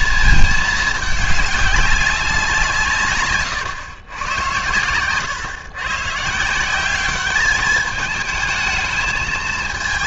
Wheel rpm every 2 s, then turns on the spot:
220, 170, 110, 180, 220.
none